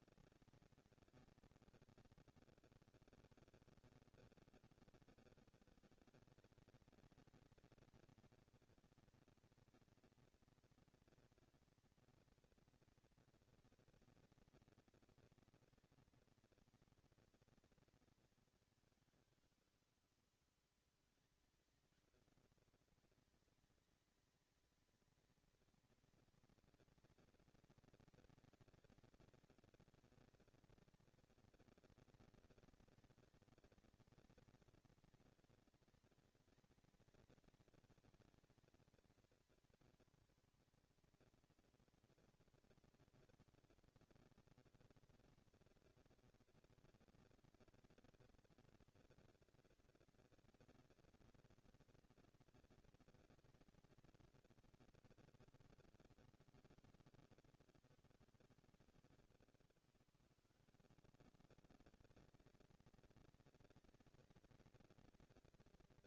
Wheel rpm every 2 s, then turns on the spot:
220, 190, 170, 200, 230, 240, 230, 220, 230, 190, 170, 220, 210, 220, 220, 230, 230, 230, 230, 210, 220, 230, 230, 230, 240, 220, 230, 220, 180, 150, 90, 180, 220.
none